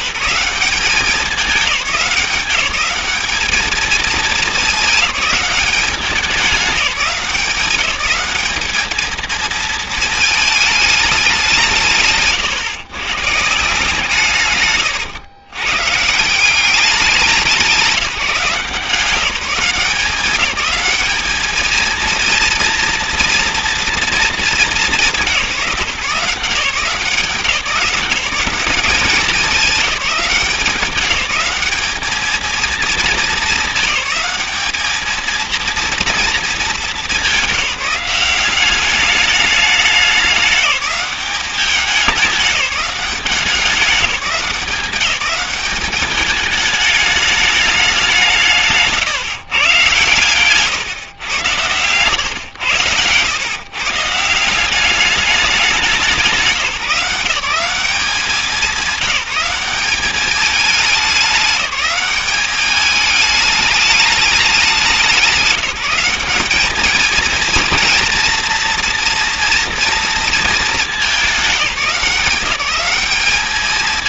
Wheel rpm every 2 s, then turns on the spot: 190, 200, 210, 200, 210, 220, 130, 120, 190, 160, 200, 230, 210, 180, 190, 190, 220, 210, 220, 190, 200, 190, 180, 210, 150, 130, 100, 180, 170, 190, 210, 210, 200, 210, 230, 220, 200.
none